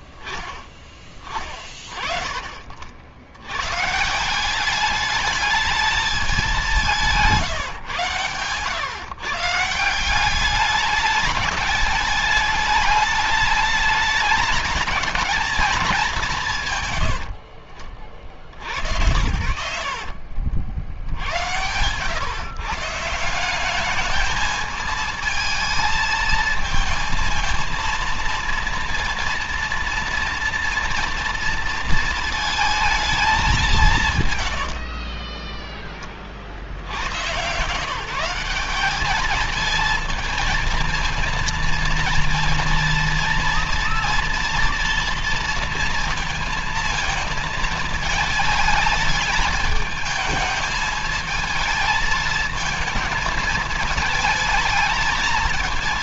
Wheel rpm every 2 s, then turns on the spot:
20, 40, 200, 200, 130, 200, 210, 210, 160, 60, 60, 140, 220, 230, 230, 230, 220, 110, 70, 190, 220, 230, 240, 220, 220, 220, 220, 220.
34-36